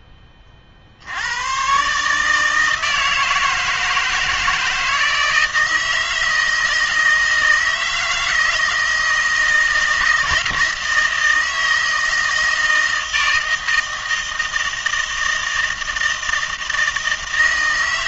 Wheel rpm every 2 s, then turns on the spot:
60, 160, 160, 160, 160, 160, 160, 160, 160.
none